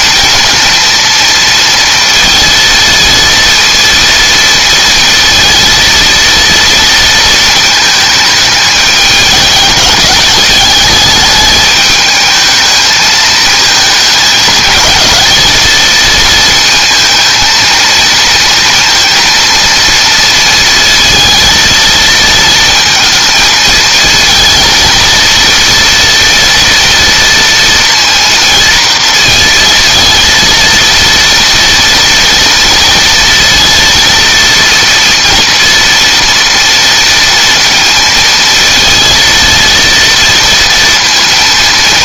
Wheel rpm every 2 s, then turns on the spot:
230, 230, 230, 230, 210, 210, 220, 220, 220, 230, 230, 220, 230, 230, 230, 230, 230, 230, 230, 230, 230.
none